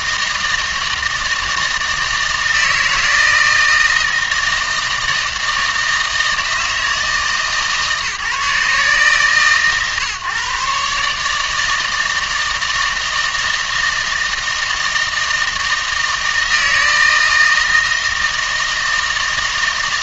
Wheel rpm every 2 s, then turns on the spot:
160, 160, 160, 160, 150, 150, 160, 160, 160, 160.
none